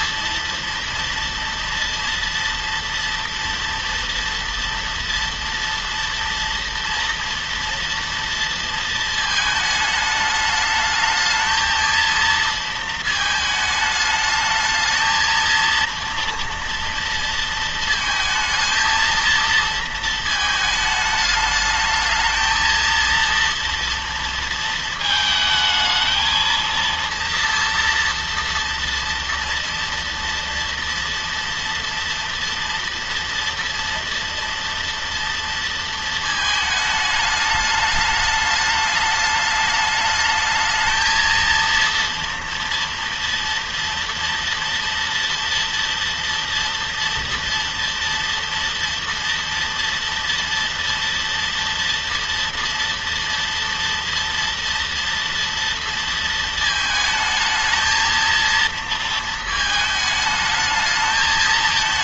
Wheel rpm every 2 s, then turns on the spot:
240, 240, 230, 230, 230, 210, 230, 220, 230, 220, 220, 220, 230, 230, 240, 230, 230, 230, 220, 210, 220, 230, 230, 240, 230, 230, 240, 230, 220, 230, 220.
none